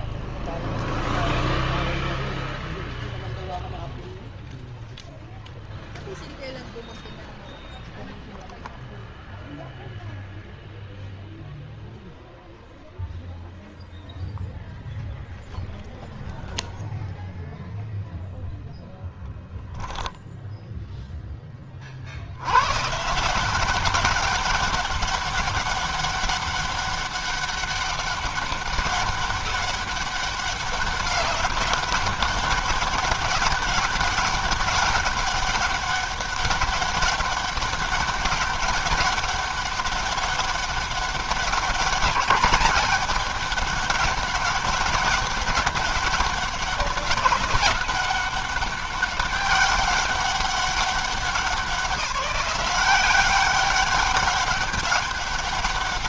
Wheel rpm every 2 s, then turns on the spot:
0, 0, 0, 0, 0, 0, 0, 0, 0, 0, 10, 170, 200, 200, 200, 200, 200, 200, 190, 200, 200, 200, 200, 190, 200, 190, 180, 200.
none